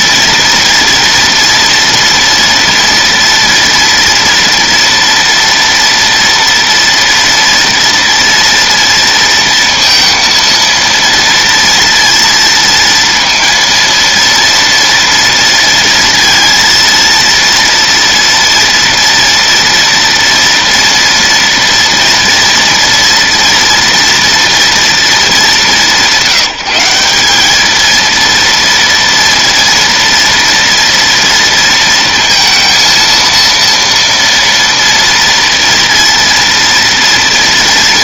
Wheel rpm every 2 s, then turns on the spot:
230, 230, 230, 230, 230, 230, 230, 230, 230, 230, 230, 230, 230, 180, 240, 230, 230, 230, 230.
none